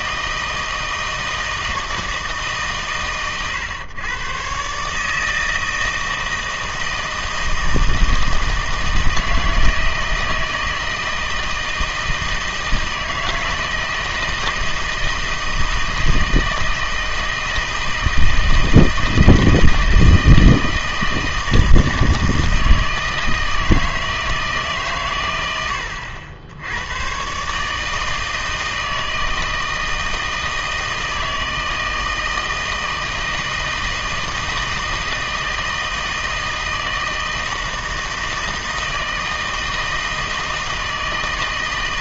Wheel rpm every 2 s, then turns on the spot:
160, 140, 140, 160, 160, 160, 160, 160, 160, 160, 160, 160, 150, 90, 160, 160, 160, 160, 160, 160, 160.
none